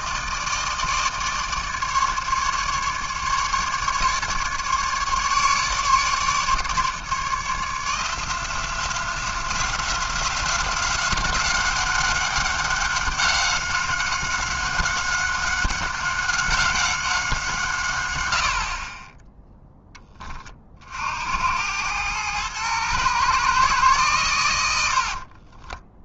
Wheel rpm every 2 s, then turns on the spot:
150, 150, 150, 150, 180, 190, 190, 190, 180, 10, 80, 120, 50.
24-26